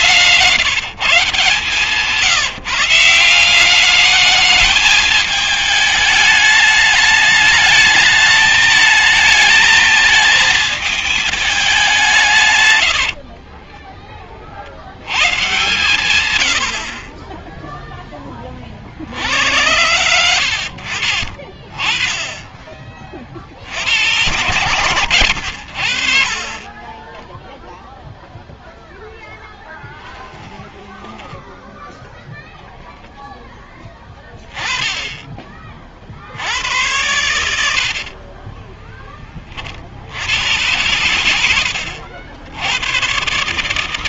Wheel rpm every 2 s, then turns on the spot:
160, 160, 210, 210, 220, 220, 130, 60, 80, 50, 70, 30, 90, 20, 0, 10, 0, 20, 100, 30, 110, 110.
12-14 30-32 38-40